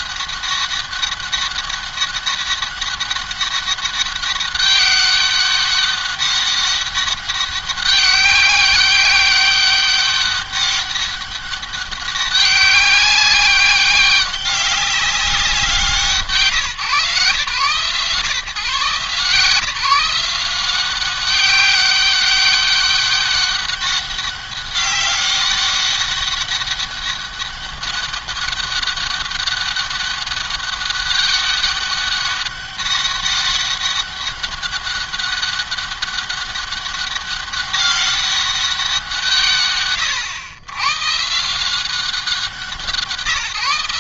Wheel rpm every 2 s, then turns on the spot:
200, 200, 190, 200, 200, 200, 200, 190, 150, 130, 180, 200, 200, 200, 200, 200, 200, 200, 200, 180, 110, 180.
none